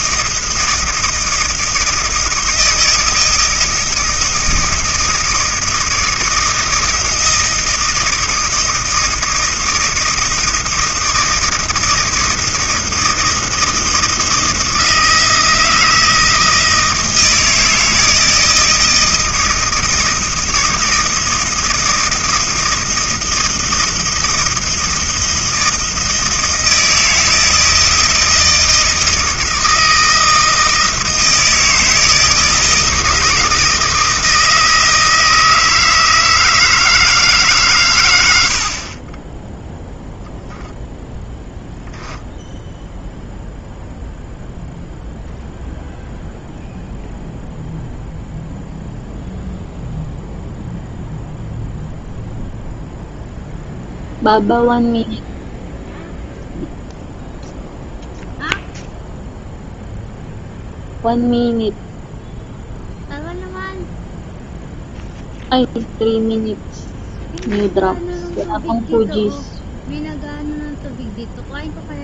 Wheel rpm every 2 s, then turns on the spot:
160, 160, 160, 160, 160, 160, 160, 160, 160, 160, 160, 160, 160, 160, 160, 160, 160, 160, 160, 40, 0, 0, 0, 0, 0, 0, 0, 0, 0, 0, 0, 0, 0, 0, 0, 0.
none